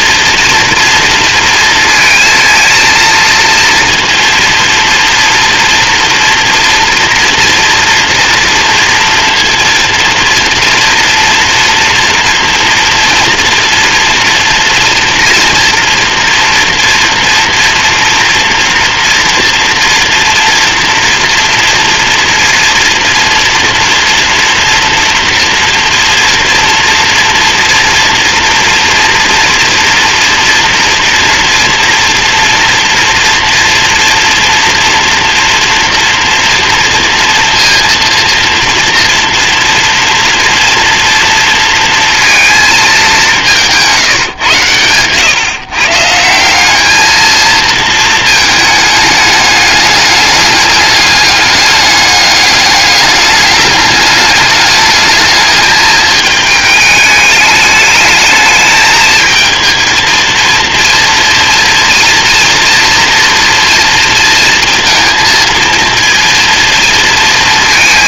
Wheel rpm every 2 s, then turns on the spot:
230, 230, 230, 230, 230, 230, 230, 230, 230, 230, 230, 230, 230, 230, 230, 230, 230, 230, 230, 230, 230, 220, 110, 190, 220, 210, 210, 210, 220, 220, 230, 230, 230, 230.
none